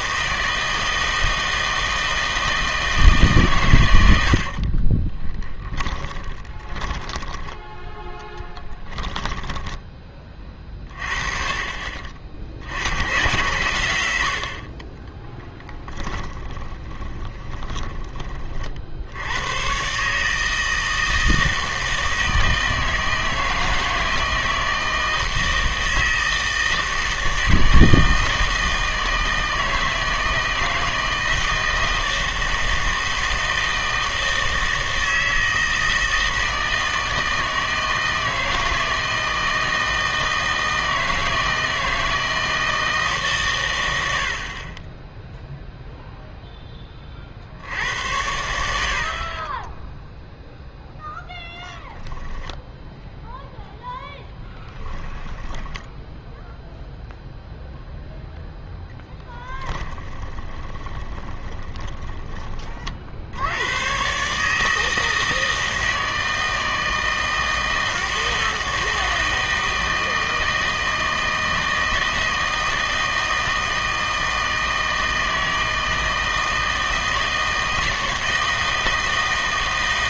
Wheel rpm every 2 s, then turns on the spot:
160, 160, 40, 20, 10, 40, 90, 40, 20, 50, 160, 160, 160, 160, 160, 160, 160, 160, 160, 160, 160, 160, 50, 10, 70, 0, 0, 10, 0, 0, 20, 30, 150, 160, 160, 160, 160, 160, 160, 160.
4-10 16-18 60-62